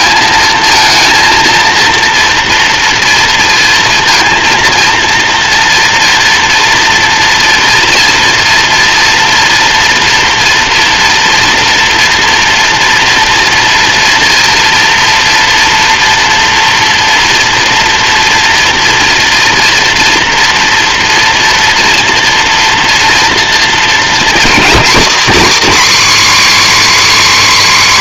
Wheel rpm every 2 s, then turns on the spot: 230, 230, 230, 230, 230, 230, 230, 230, 240, 230, 230, 230, 270, 300.
none